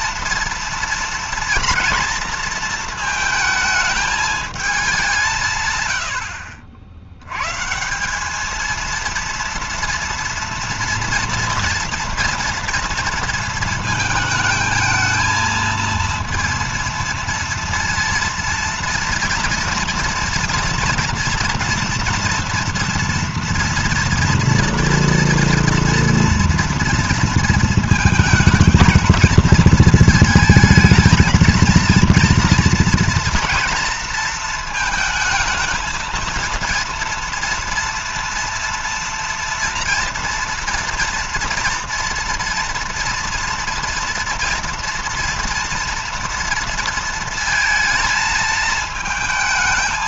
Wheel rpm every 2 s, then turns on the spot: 230, 230, 210, 60, 210, 230, 240, 220, 230, 230, 240, 240, 230, 230, 220, 220, 230, 230, 230, 230, 230, 230, 230, 230, 220.
none